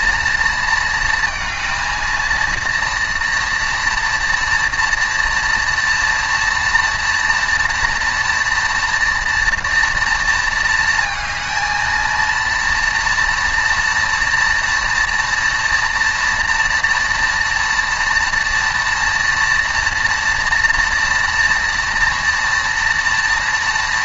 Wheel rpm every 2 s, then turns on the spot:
230, 230, 230, 230, 230, 220, 230, 240, 230, 230, 230, 230.
none